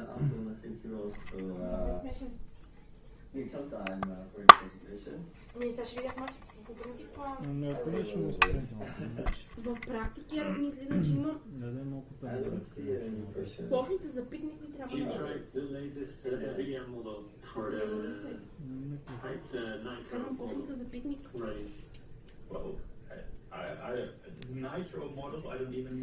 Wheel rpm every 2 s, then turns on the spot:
0, 0, 0, 0, 0, 0, 0, 0, 0, 0, 0, 0, 0.
none